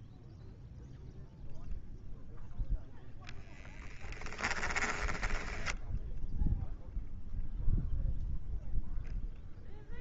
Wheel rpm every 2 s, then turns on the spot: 0, 0, 10, 0, 0.
4-6